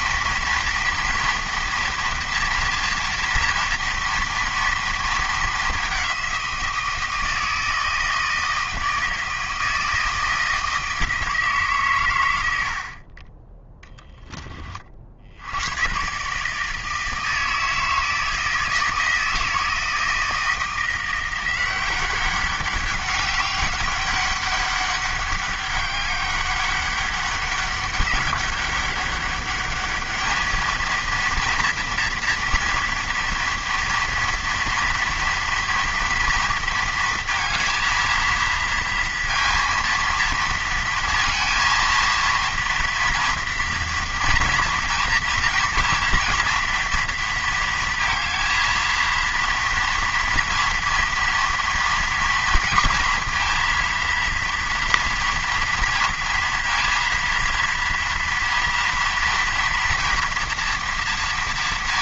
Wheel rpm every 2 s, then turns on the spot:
230, 230, 230, 180, 160, 160, 80, 30, 150, 160, 170, 190, 200, 200, 200, 220, 230, 230, 230, 230, 230, 230, 230, 230, 230, 230, 230, 230, 230, 230, 230.
none